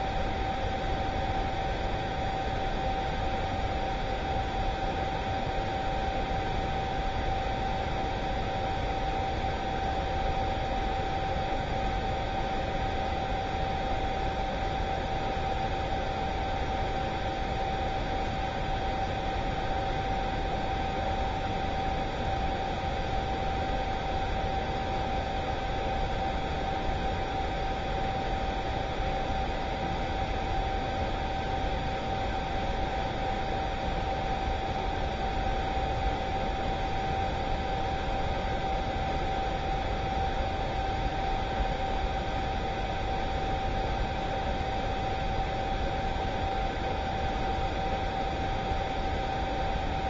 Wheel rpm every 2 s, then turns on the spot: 0, 0, 0, 0, 0, 0, 0, 0, 0, 0, 0, 0, 0, 0, 0, 0, 0, 0, 0, 0, 0, 0, 0, 0, 0.
none